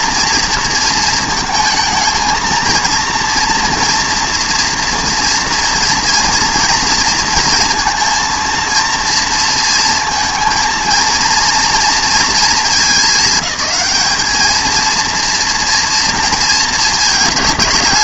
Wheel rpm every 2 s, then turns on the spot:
230, 230, 230, 230, 230, 230, 210, 220, 230.
none